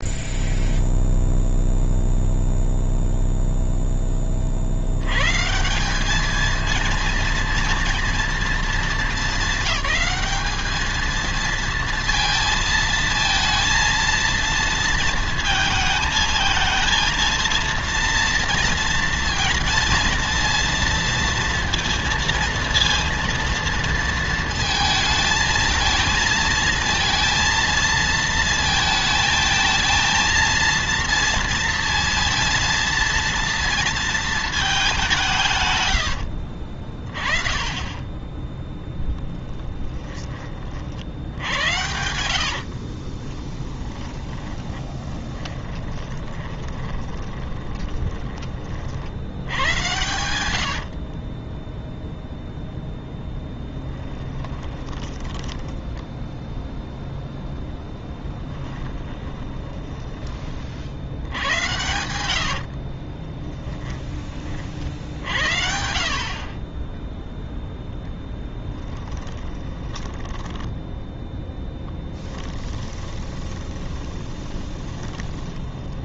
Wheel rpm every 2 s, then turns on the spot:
0, 0, 50, 220, 230, 210, 230, 230, 220, 230, 230, 230, 230, 230, 220, 230, 230, 210, 50, 10, 40, 60, 10, 20, 40, 80, 0, 20, 0, 20, 50, 70, 40, 30, 10, 10, 30, 20.
42-48 50-52 54-56 58-60 62-64 68-76